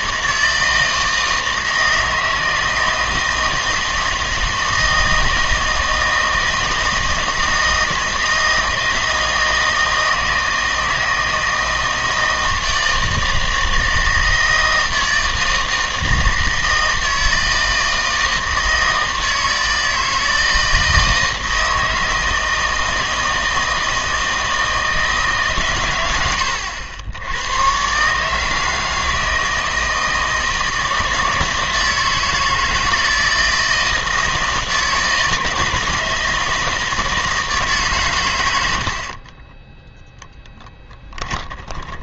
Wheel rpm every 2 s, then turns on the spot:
160, 160, 160, 160, 160, 160, 160, 160, 160, 160, 160, 160, 160, 90, 160, 160, 160, 160, 160, 80, 10.
40-42